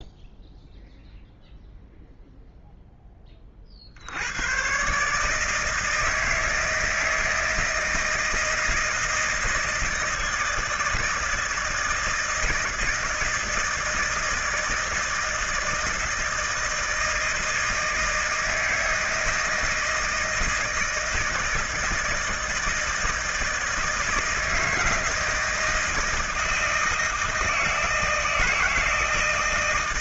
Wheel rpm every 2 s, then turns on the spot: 0, 0, 120, 160, 160, 160, 160, 160, 160, 160, 160, 160, 160, 160, 160.
none